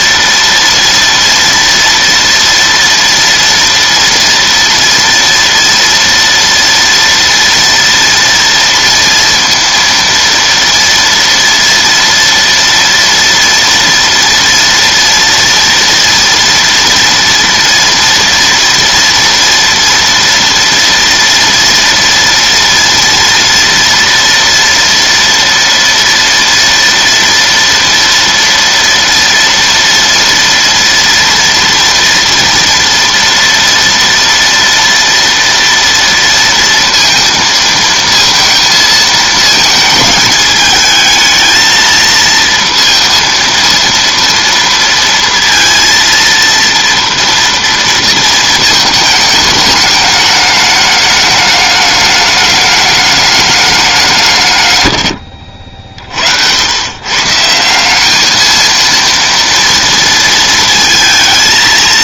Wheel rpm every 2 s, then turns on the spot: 230, 230, 230, 230, 230, 230, 230, 230, 230, 230, 230, 230, 230, 230, 230, 240, 230, 230, 230, 230, 220, 230, 230, 230, 220, 210, 210, 140, 90, 220, 230.
none